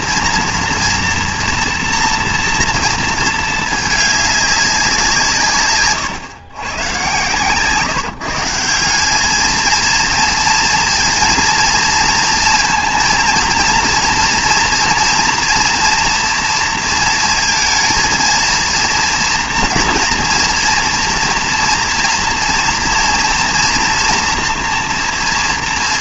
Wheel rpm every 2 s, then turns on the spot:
230, 230, 200, 120, 160, 230, 230, 230, 230, 230, 230, 230, 230.
none